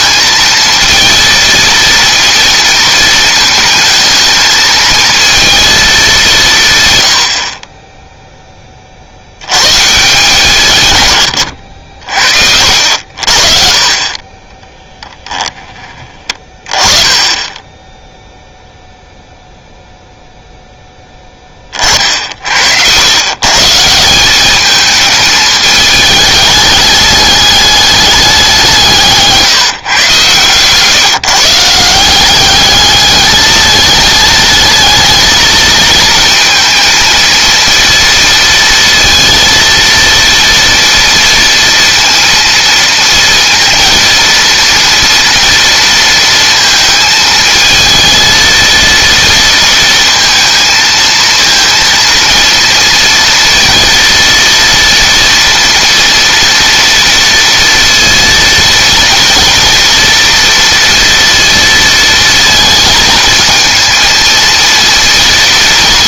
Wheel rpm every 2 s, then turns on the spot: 230, 220, 220, 120, 40, 150, 60, 10, 20, 0, 0, 90, 210, 210, 170, 140, 210, 220, 230, 230, 230, 230, 230, 220, 230, 230, 230, 230, 230, 230, 230, 230, 230.
12-18